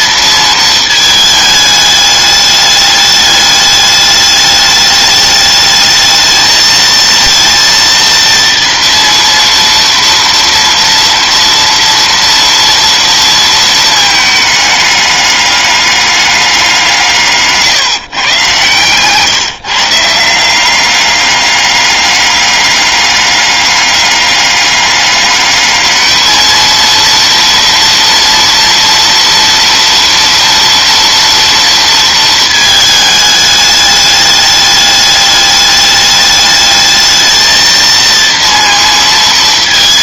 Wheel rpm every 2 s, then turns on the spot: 220, 210, 210, 220, 230, 230, 230, 210, 170, 130, 200, 200, 200, 230, 230, 240, 220, 210, 220, 230.
none